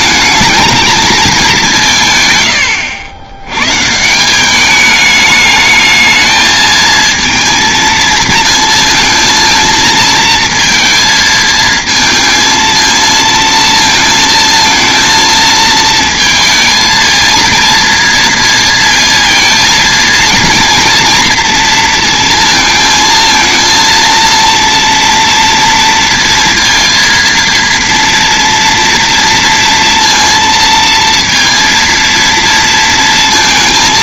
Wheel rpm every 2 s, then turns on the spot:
220, 120, 200, 220, 230, 230, 230, 220, 230, 230, 240, 230, 230, 230, 240, 230, 230.
none